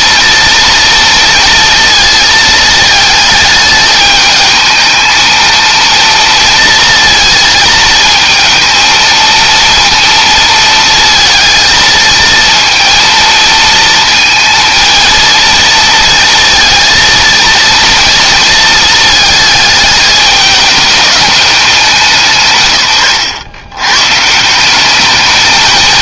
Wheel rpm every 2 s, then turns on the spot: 230, 220, 220, 230, 230, 230, 230, 230, 230, 220, 210, 120, 190.
none